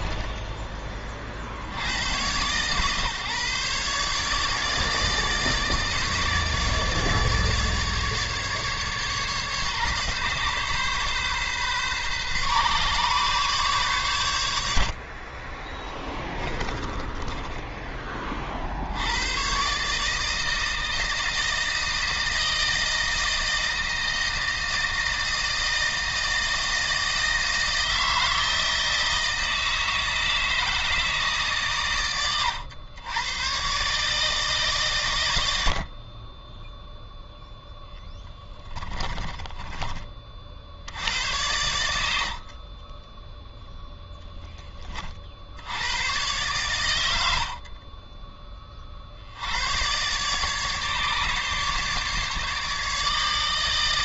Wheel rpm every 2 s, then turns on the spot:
20, 140, 150, 150, 140, 140, 140, 60, 20, 80, 160, 160, 160, 160, 160, 160, 110, 130, 0, 20, 70, 20, 30, 100, 50, 150, 150.
14-18 38-40 42-44